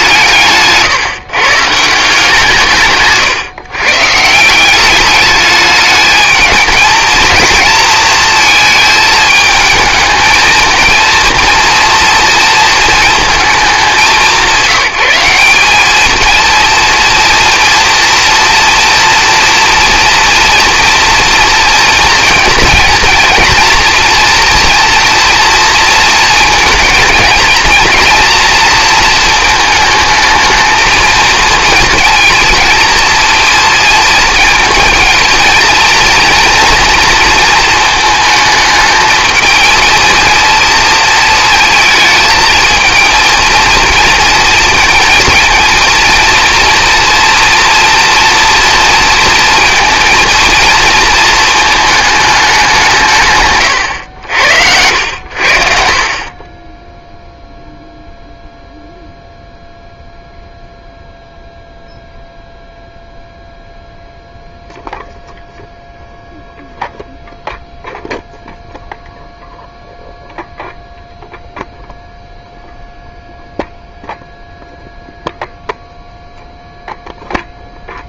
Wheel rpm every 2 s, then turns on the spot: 160, 170, 170, 220, 220, 220, 230, 190, 230, 230, 230, 230, 230, 220, 230, 220, 230, 230, 230, 220, 220, 220, 230, 230, 230, 230, 200, 90, 30, 0, 0, 0, 0, 0, 0, 0, 0, 0, 0.
56-58